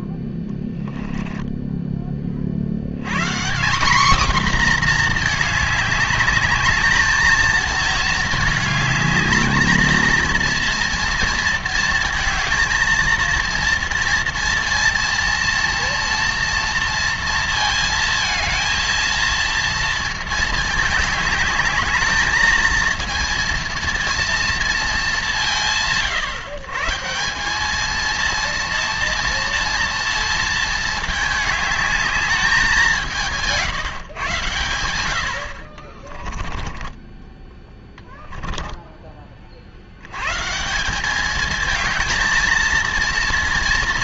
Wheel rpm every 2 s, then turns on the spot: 10, 70, 250, 210, 220, 230, 230, 230, 230, 220, 220, 220, 230, 140, 230, 220, 200, 100, 20, 10, 160, 220.
0-2 36-40